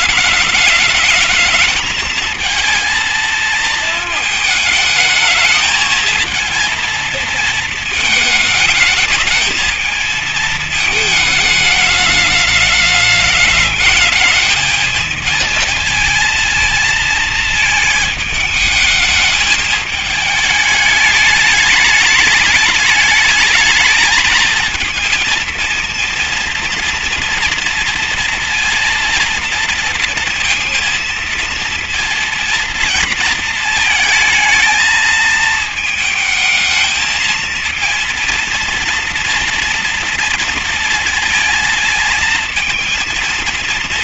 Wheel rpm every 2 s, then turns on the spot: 220, 220, 220, 220, 220, 220, 210, 220, 230, 220, 220, 210, 230, 230, 230, 230, 230, 220, 220, 240, 230, 220.
none